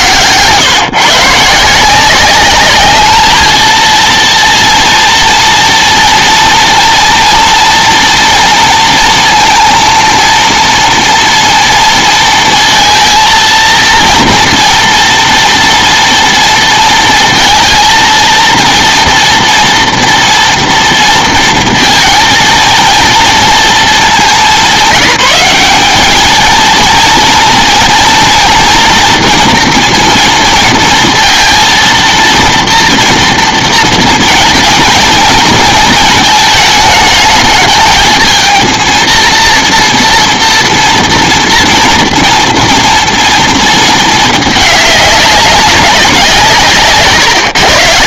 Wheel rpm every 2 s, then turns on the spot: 130, 200, 230, 230, 230, 240, 230, 230, 230, 230, 230, 230, 190, 230, 230, 230, 230, 230, 220, 230, 230, 230, 210, 160.
none